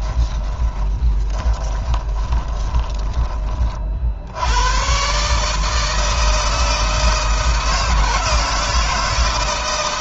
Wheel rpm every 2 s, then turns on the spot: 20, 20, 110, 160, 170.
0-4